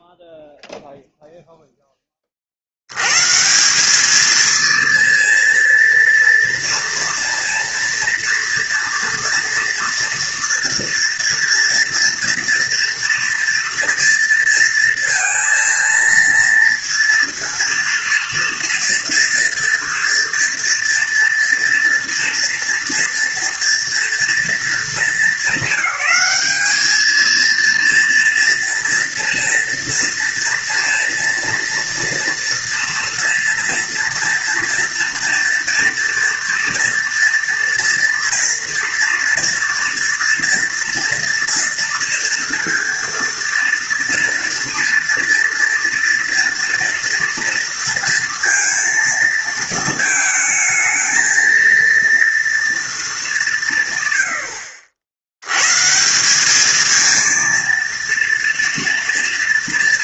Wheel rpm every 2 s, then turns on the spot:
0, 50, 230, 230, 230, 230, 240, 230, 230, 230, 230, 230, 220, 210, 230, 230, 230, 230, 230, 230, 230, 230, 230, 230, 230, 220, 230, 80, 200, 230.
none